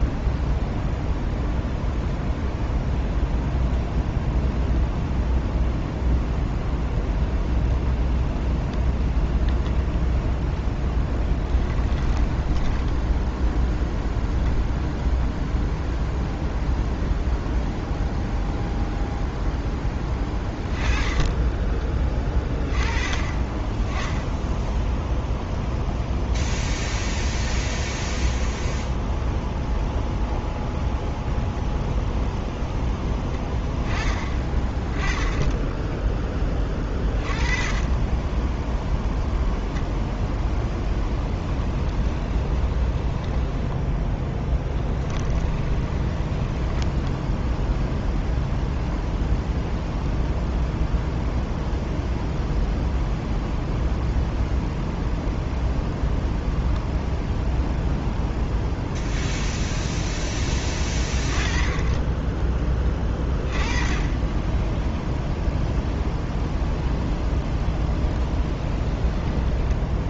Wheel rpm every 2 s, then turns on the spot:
0, 0, 0, 0, 0, 0, 10, 0, 0, 0, 20, 20, 0, 0, 0, 0, 0, 30, 20, 10, 0, 20, 10, 10, 0, 0, 0, 0, 0, 0, 10, 20, 10, 0, 10.
42-48 68-70